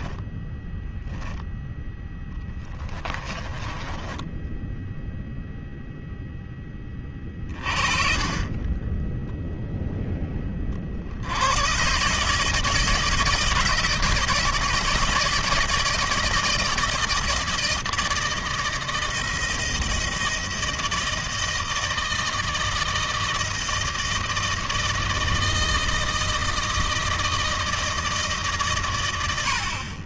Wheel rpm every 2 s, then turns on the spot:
20, 0, 20, 0, 20, 30, 150, 160, 160, 160, 160, 160, 160, 160, 110.
0-2 4-6